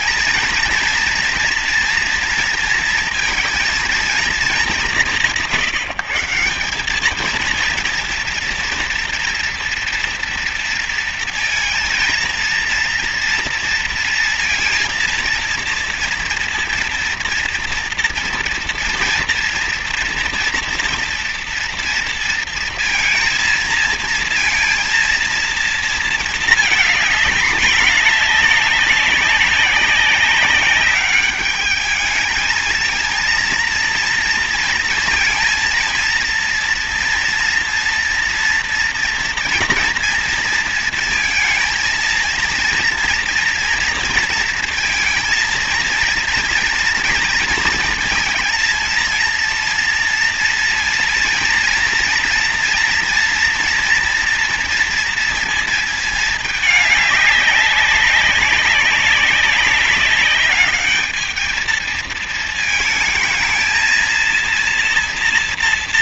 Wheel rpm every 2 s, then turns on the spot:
230, 230, 190, 190, 240, 230, 230, 230, 230, 230, 230, 230, 230, 220, 200, 190, 220, 230, 230, 230, 230, 230, 230, 230, 230, 230, 230, 230, 210, 200, 210, 220, 230.
none